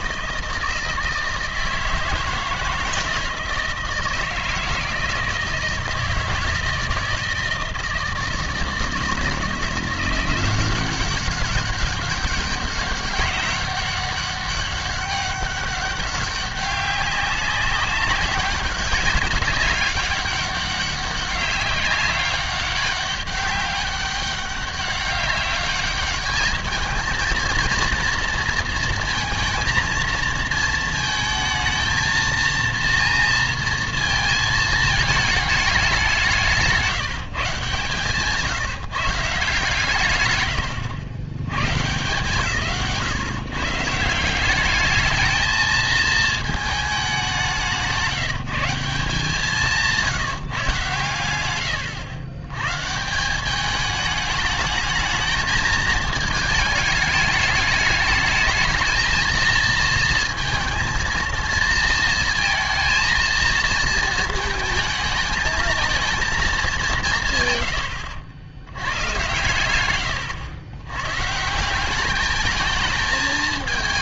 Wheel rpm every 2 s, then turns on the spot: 160, 160, 160, 160, 160, 180, 190, 200, 200, 200, 200, 200, 200, 210, 230, 220, 230, 220, 170, 150, 90, 130, 200, 220, 180, 140, 110, 210, 220, 220, 230, 230, 220, 200, 90, 110, 210.
none